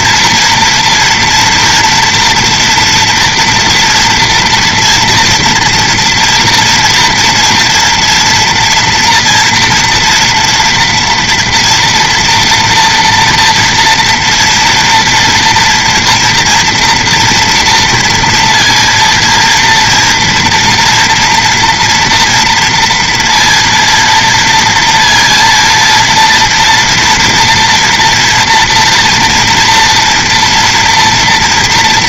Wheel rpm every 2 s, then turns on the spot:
240, 240, 230, 230, 230, 230, 230, 230, 230, 230, 230, 230, 230, 230, 230, 230.
none